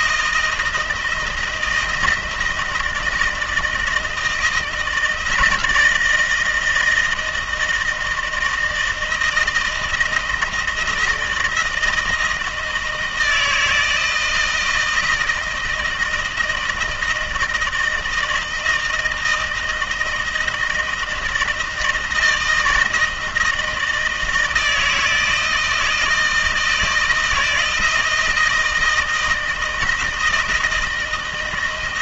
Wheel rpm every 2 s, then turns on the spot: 160, 160, 170, 160, 160, 170, 160, 160, 160, 160, 160, 160, 160, 160, 160, 160.
none